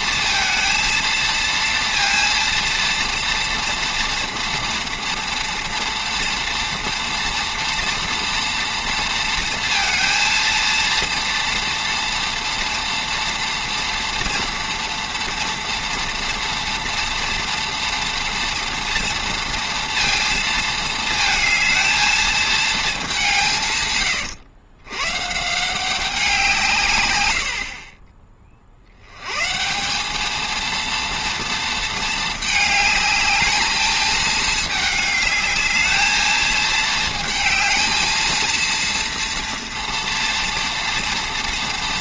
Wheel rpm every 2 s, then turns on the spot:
230, 230, 240, 230, 230, 230, 230, 230, 230, 230, 220, 220, 120, 160, 60, 230, 210, 210, 220, 230, 230.
none